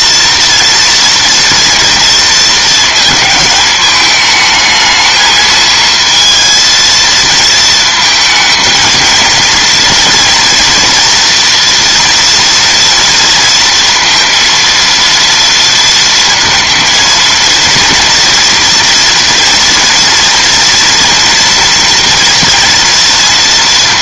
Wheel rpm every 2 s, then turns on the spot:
230, 230, 220, 230, 220, 230, 230, 230, 230, 230, 230, 230.
none